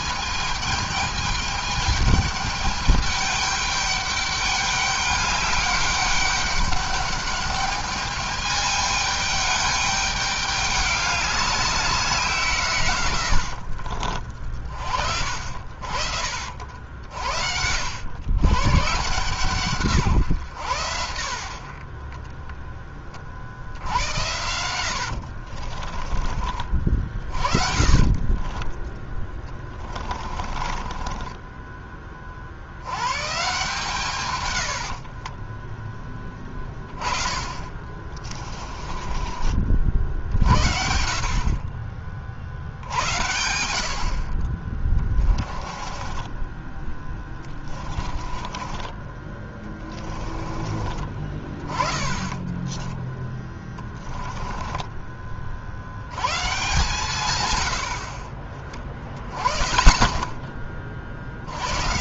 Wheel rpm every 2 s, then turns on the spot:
220, 210, 200, 200, 210, 200, 130, 40, 60, 130, 100, 20, 90, 40, 20, 30, 90, 70, 10, 20, 50, 60, 20, 10, 20, 30, 20, 20, 150, 30, 30.
24-26 28-32 34-36 38-40 44-50 52-54